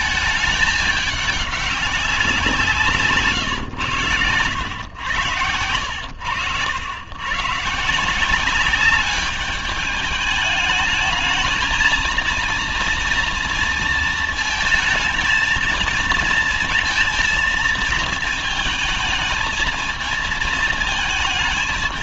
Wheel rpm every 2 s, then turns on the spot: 210, 180, 110, 80, 190, 210, 230, 220, 230, 220, 230.
none